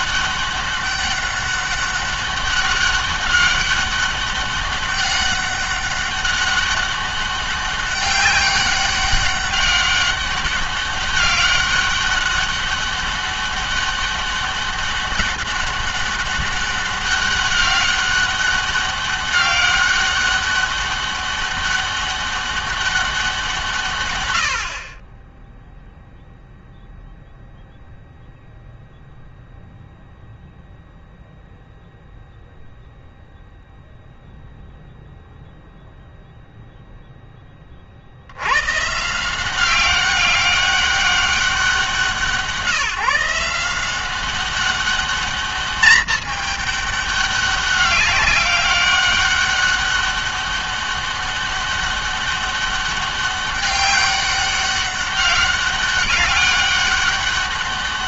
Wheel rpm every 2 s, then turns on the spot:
200, 200, 200, 200, 200, 200, 200, 200, 200, 200, 200, 200, 60, 0, 0, 0, 0, 0, 0, 130, 200, 160, 200, 210, 200, 200, 200, 200, 200.
none